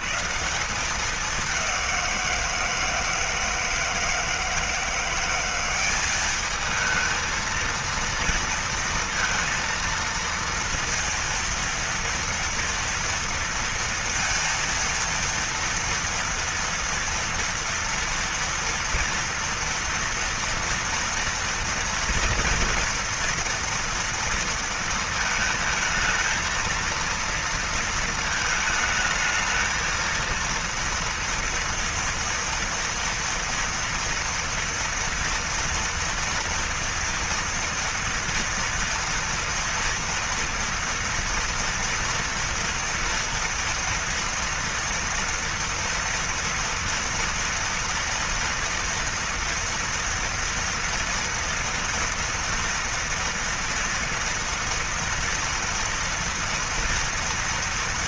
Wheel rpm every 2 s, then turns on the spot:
130, 180, 160, 200, 230, 230, 230, 230, 230, 230, 240, 230, 230, 220, 220, 220, 230, 240, 230, 230, 230, 230, 230, 230, 230, 230, 230, 230, 230.
none